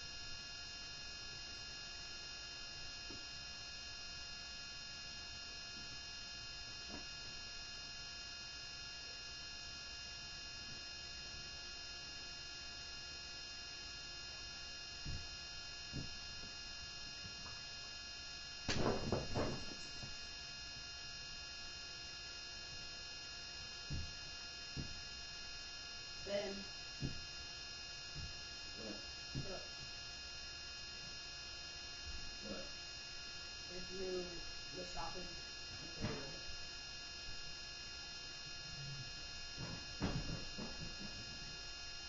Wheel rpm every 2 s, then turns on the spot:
0, 0, 0, 0, 0, 0, 0, 0, 0, 0, 0, 0, 0, 0, 0, 0, 0, 0, 0, 0, 0.
none